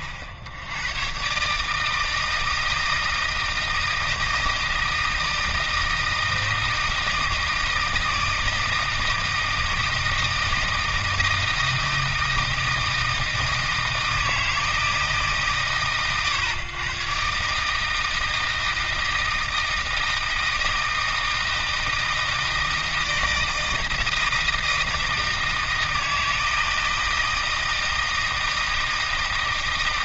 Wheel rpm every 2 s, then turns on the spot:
60, 160, 160, 160, 160, 160, 160, 160, 110, 160, 160, 160, 160, 160, 160.
none